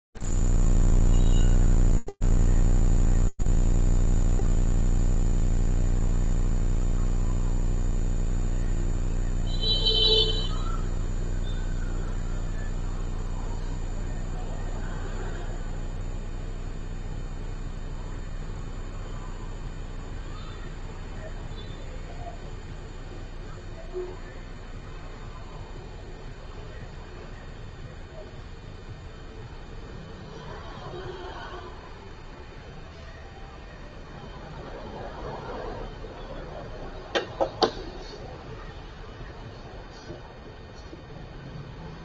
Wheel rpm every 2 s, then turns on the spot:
0, 0, 0, 0, 0, 0, 0, 0, 0, 0, 0, 0, 0, 0, 0, 0, 0, 0, 0, 0, 0.
none